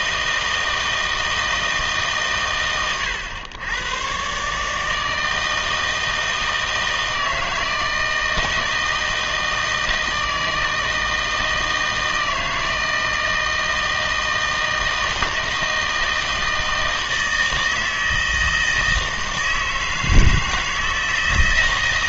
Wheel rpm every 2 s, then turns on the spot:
160, 120, 150, 160, 160, 160, 160, 160, 160, 160, 160.
none